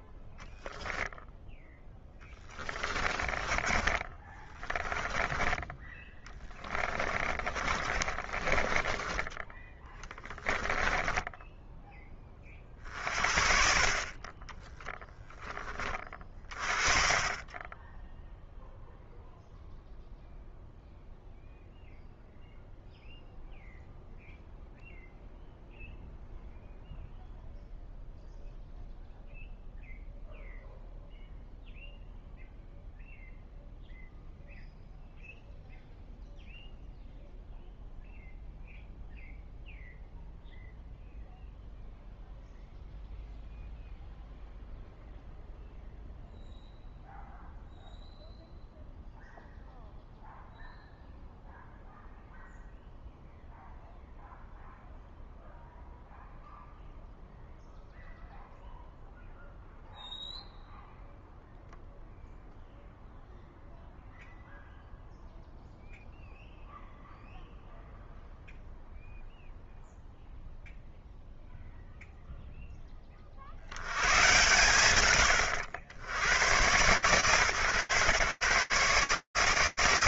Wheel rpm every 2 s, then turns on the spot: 0, 20, 20, 20, 20, 10, 40, 10, 30, 0, 0, 0, 0, 0, 0, 0, 0, 0, 0, 0, 0, 0, 0, 0, 0, 0, 0, 0, 0, 0, 0, 0, 0, 0, 0, 0, 0, 120, 120, 140.
2-10